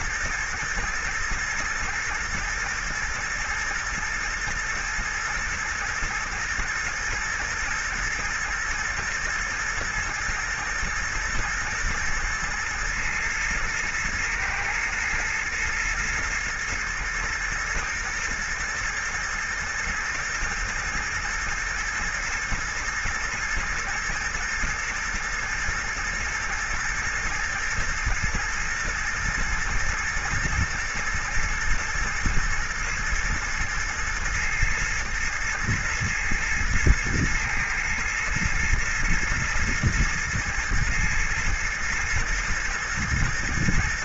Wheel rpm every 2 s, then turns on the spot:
110, 110, 110, 110, 120, 110, 110, 120, 120, 110, 110, 110, 120, 110, 120, 110, 110, 110, 110, 110, 110, 120.
none